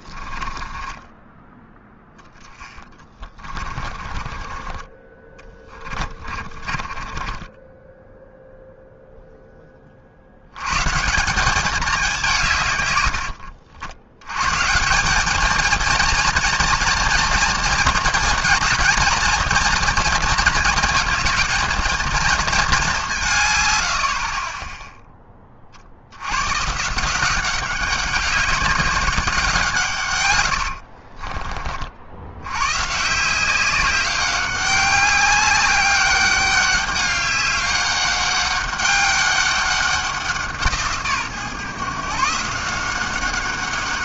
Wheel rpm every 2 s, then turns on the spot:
20, 10, 30, 30, 0, 110, 140, 150, 230, 230, 220, 210, 10, 120, 190, 90, 120, 200, 200, 200, 170, 170.
0-8 30-32